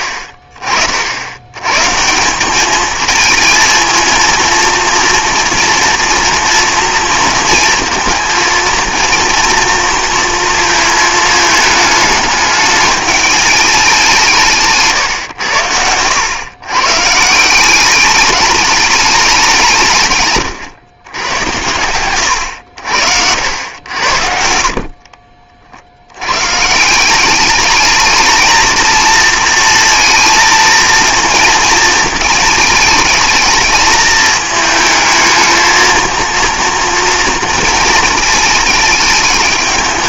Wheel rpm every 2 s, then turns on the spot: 60, 210, 230, 230, 230, 230, 210, 150, 130, 210, 120, 90, 60, 150, 220, 230, 220, 220, 230, 210.
14-16 24-26